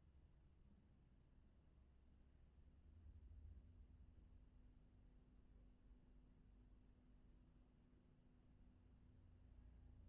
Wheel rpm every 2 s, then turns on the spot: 0, 0, 0, 0, 0.
none